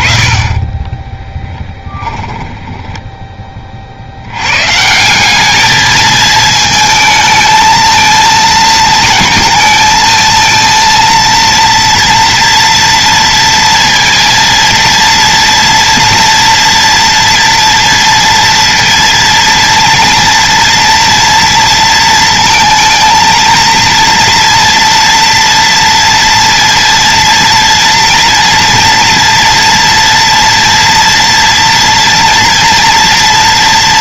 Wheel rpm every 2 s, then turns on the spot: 10, 20, 160, 220, 220, 230, 230, 230, 230, 230, 230, 230, 230, 230, 230, 240, 230.
0-4